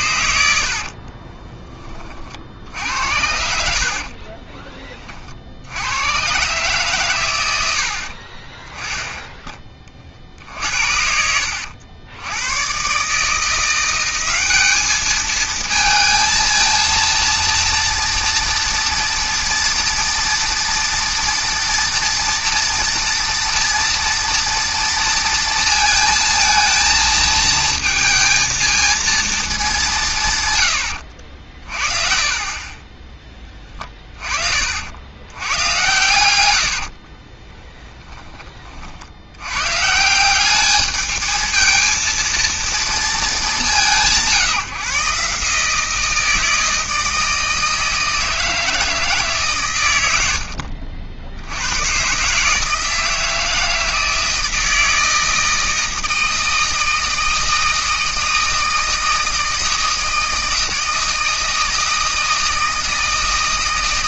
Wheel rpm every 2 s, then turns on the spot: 70, 70, 20, 130, 20, 60, 110, 200, 230, 230, 240, 230, 230, 220, 220, 100, 30, 50, 80, 40, 200, 230, 150, 160, 160, 60, 160, 160, 160, 160, 160, 160.
4-6 30-32 36-38 50-52